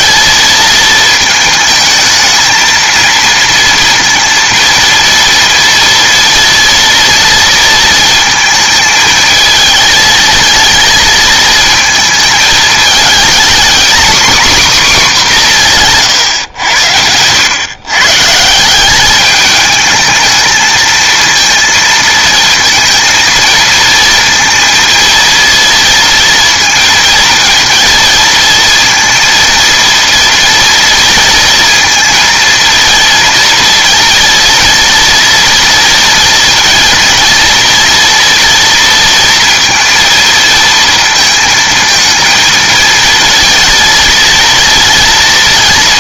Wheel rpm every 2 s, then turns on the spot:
220, 230, 230, 230, 220, 220, 220, 280, 100, 180, 220, 230, 230, 230, 230, 230, 230, 230, 230, 230, 230, 230, 230.
none